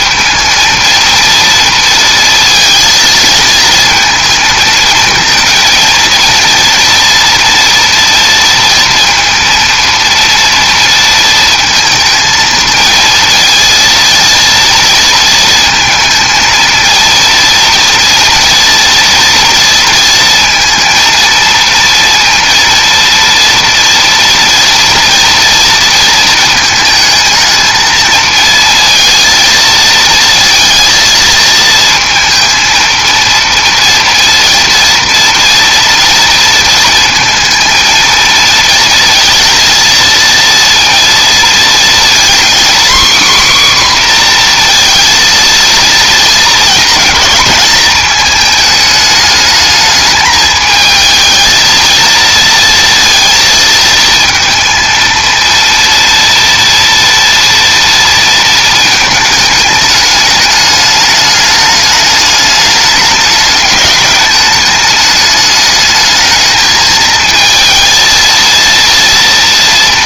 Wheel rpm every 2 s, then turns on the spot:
230, 230, 220, 230, 230, 230, 230, 230, 230, 230, 230, 230, 230, 220, 220, 230, 230, 230, 230, 220, 230, 260, 240, 220, 220, 220, 230, 230, 230, 230, 210, 210, 210, 220, 230.
none